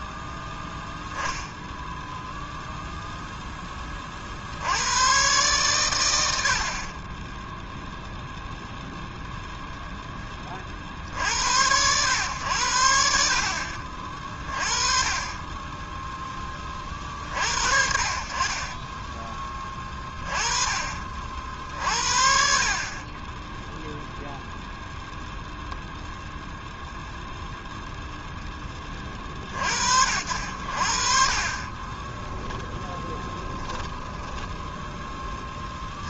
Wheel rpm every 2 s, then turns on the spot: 0, 0, 100, 30, 0, 50, 80, 30, 30, 10, 40, 40, 0, 0, 20, 60, 10, 10.
18-20 32-34